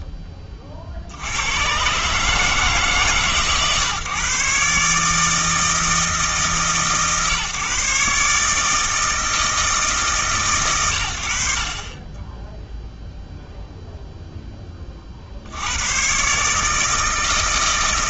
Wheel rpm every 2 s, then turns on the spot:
30, 150, 140, 150, 150, 120, 0, 20, 150.
none